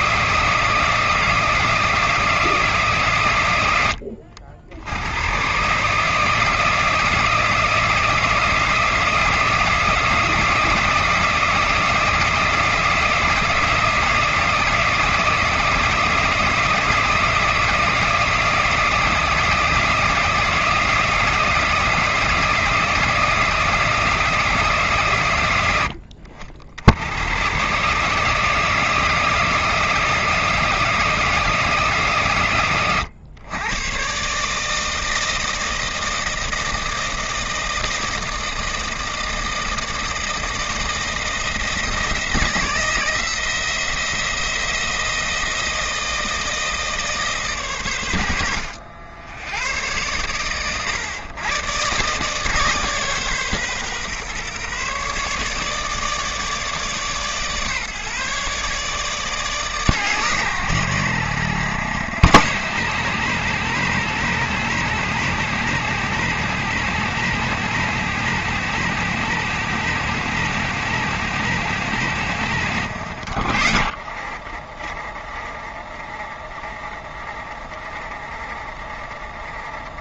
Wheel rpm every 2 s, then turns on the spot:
160, 120, 100, 160, 160, 160, 160, 160, 160, 160, 160, 160, 120, 110, 160, 160, 110, 160, 160, 160, 170, 170, 160, 140, 90, 120, 140, 150, 150, 150, 80, 120, 130, 120, 120, 120, 70, 20, 20, 20.
none